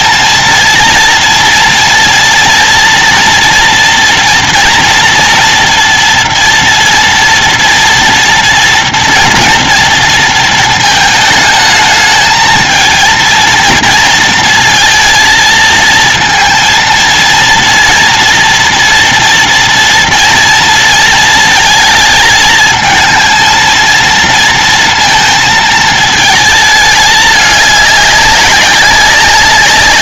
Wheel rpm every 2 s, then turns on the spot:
230, 230, 240, 230, 230, 220, 220, 230, 230, 230, 230, 220, 230, 210, 190.
none